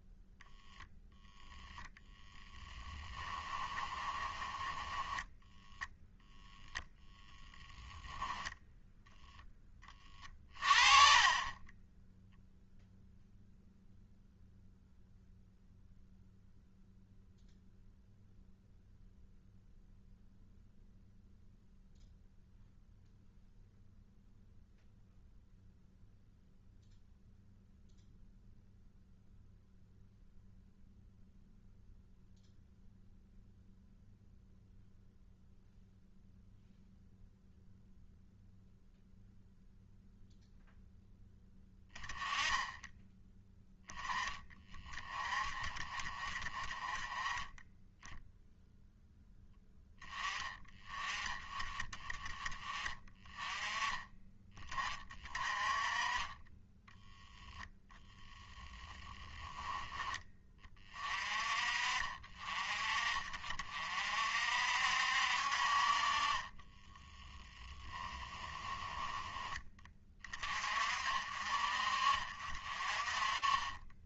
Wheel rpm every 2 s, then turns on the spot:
0, 10, 10, 0, 0, 30, 0, 0, 0, 0, 0, 0, 0, 0, 0, 0, 0, 0, 0, 0, 0, 10, 20, 20, 0, 20, 20, 30, 10, 20, 30, 40, 60, 10, 10, 40, 40.
2-4 58-60 66-68